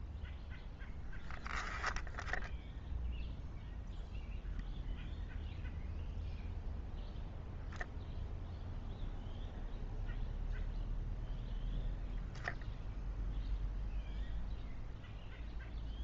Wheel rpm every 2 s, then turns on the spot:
0, 0, 0, 0, 0, 0, 0, 0.
none